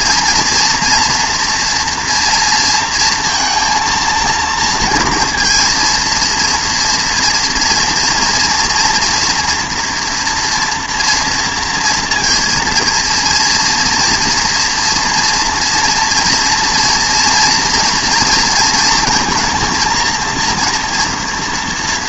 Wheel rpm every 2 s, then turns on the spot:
240, 230, 230, 230, 230, 230, 230, 230, 230, 230, 230.
none